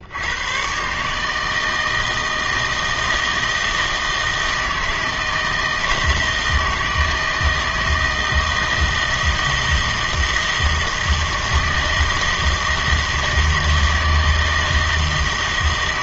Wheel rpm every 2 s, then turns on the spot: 120, 160, 160, 160, 160, 160, 160, 160.
none